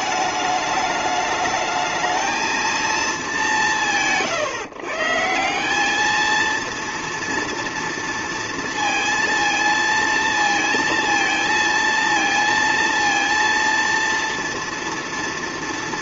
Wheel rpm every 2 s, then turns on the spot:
210, 220, 140, 230, 230, 230, 230, 230.
none